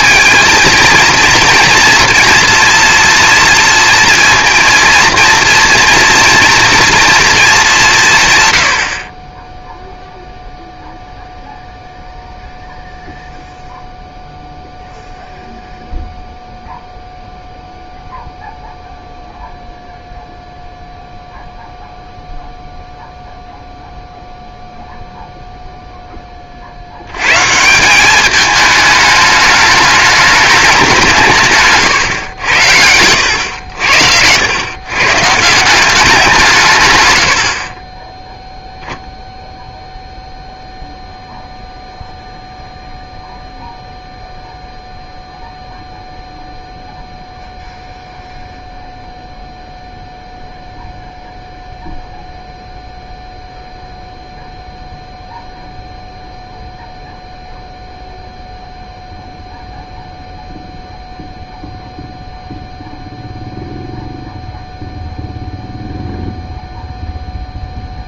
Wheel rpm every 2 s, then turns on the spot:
230, 230, 230, 230, 90, 0, 0, 0, 0, 0, 0, 0, 0, 60, 210, 200, 90, 120, 140, 0, 0, 0, 0, 0, 0, 0, 0, 0, 0, 0, 0, 0, 0, 0.
none